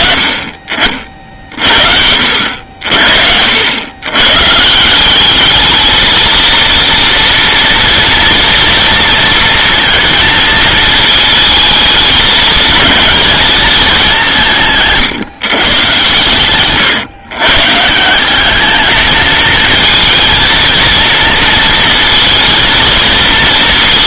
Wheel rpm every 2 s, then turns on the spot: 40, 80, 150, 230, 230, 220, 210, 170, 120, 210, 230, 230.
16-18